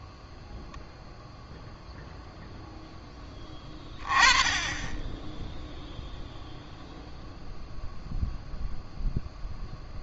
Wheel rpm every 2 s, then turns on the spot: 0, 0, 20, 0, 0.
none